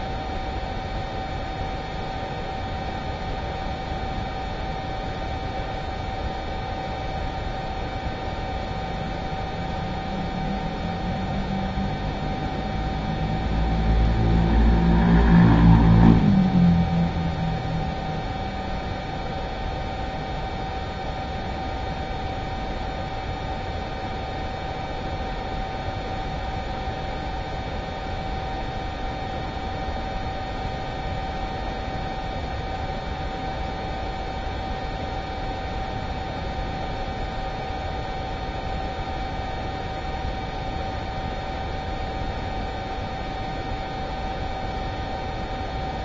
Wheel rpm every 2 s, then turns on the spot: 0, 0, 0, 0, 0, 0, 0, 0, 0, 0, 0, 0, 0, 0, 0, 0, 0, 0, 0, 0, 0, 0, 0.
none